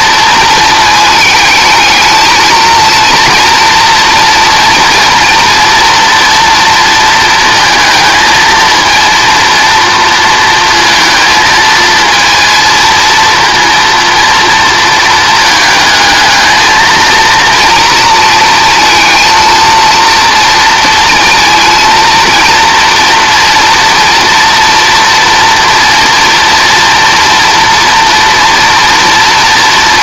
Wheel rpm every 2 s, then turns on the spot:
220, 230, 230, 230, 230, 230, 230, 230, 230, 230, 230, 230, 240, 240, 230.
none